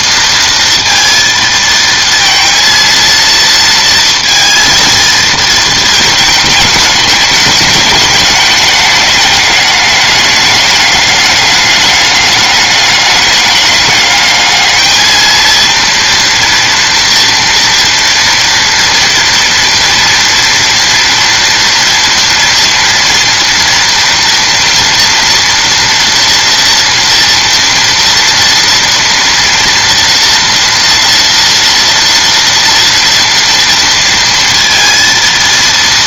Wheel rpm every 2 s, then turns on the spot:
230, 230, 230, 210, 210, 210, 200, 220, 230, 230, 230, 230, 230, 230, 230, 230, 230, 230.
none